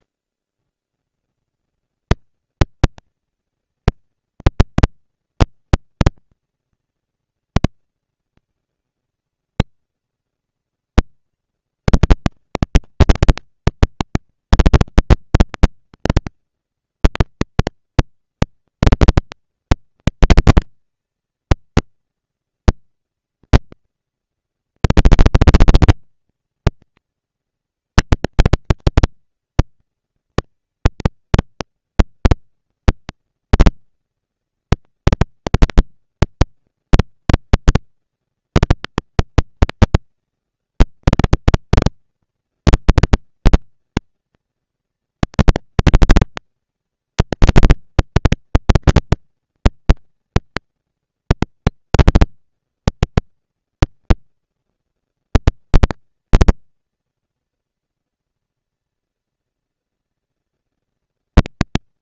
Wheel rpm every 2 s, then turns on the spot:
30, 200, 230, 240, 230, 230, 230, 230, 230, 230, 230, 230, 230, 230, 220, 220, 200, 200, 230, 230, 210, 220, 230, 230, 230, 230, 240, 230, 230, 230, 240.
none